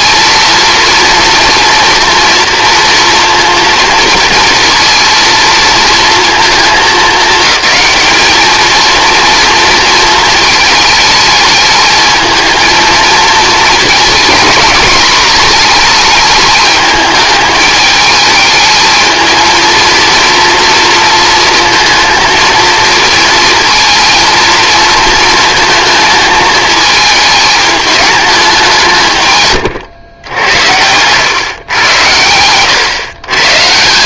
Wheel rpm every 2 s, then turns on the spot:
230, 240, 230, 220, 220, 220, 230, 230, 210, 220, 230, 230, 230, 220, 190, 90, 100.
30-32